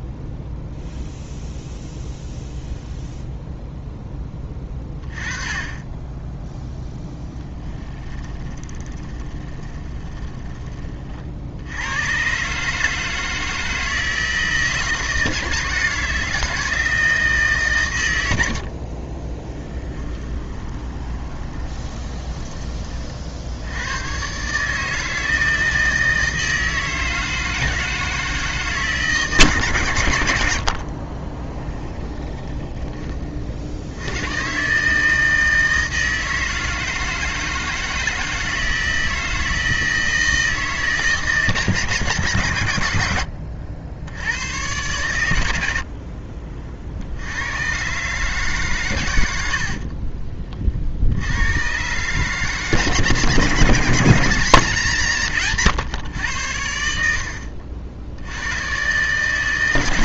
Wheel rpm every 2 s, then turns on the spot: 0, 0, 20, 10, 20, 20, 140, 160, 160, 90, 20, 20, 140, 160, 150, 70, 20, 130, 160, 160, 160, 110, 100, 40, 140, 40, 150, 160, 90, 100.
8-10 20-22 30-34